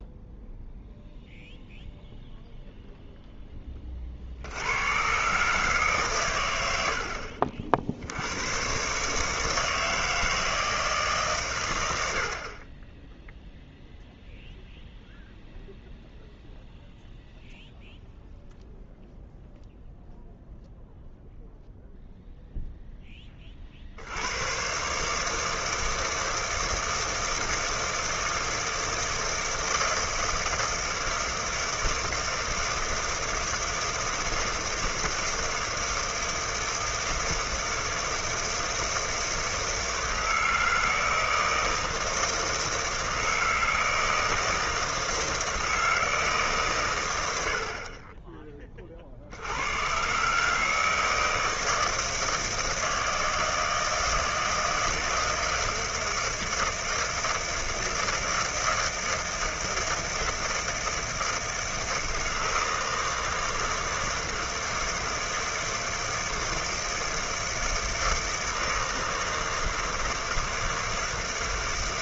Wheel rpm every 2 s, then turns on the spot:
0, 0, 90, 90, 110, 160, 30, 0, 0, 0, 0, 0, 120, 160, 160, 160, 160, 160, 160, 160, 160, 160, 160, 140, 20, 150, 160, 160, 160, 160, 160, 160, 160, 160, 160, 160.
none